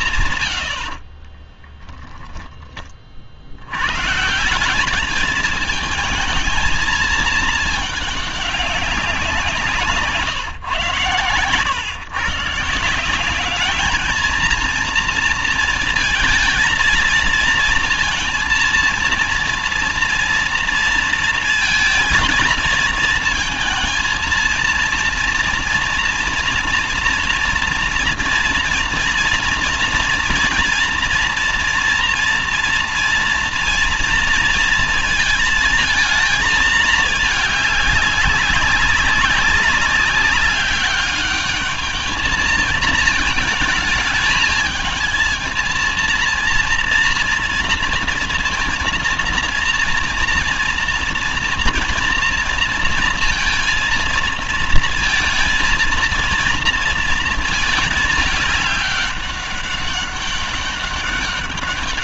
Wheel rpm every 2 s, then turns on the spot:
90, 10, 180, 220, 210, 130, 160, 230, 230, 230, 230, 220, 230, 230, 230, 230, 230, 230, 220, 200, 200, 220, 210, 230, 230, 230, 230, 230, 230, 200, 200.
0-2